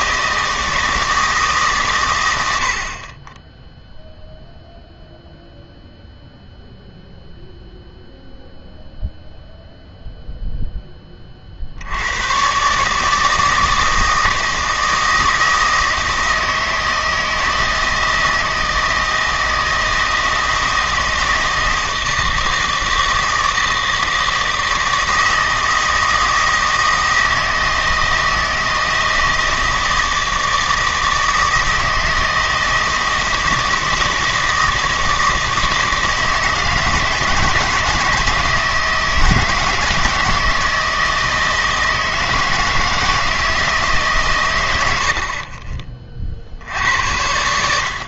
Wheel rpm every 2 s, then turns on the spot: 160, 60, 0, 0, 0, 10, 140, 160, 160, 160, 160, 160, 160, 160, 160, 160, 160, 160, 160, 160, 160, 160, 90, 70.
none